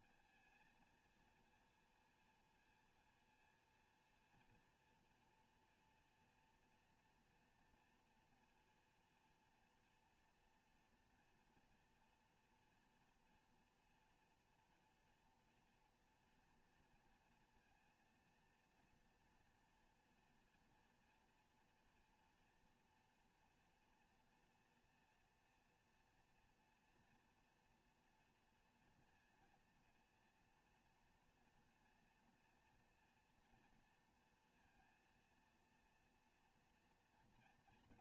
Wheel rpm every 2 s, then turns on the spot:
230, 230, 240, 230, 230, 240, 230, 230, 230, 230, 230, 230, 230, 230, 230, 230, 230, 230, 230.
none